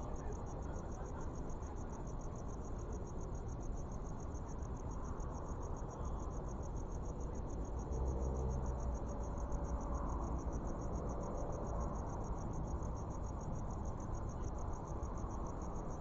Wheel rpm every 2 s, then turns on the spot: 0, 0, 0, 0, 0, 0, 0, 0.
none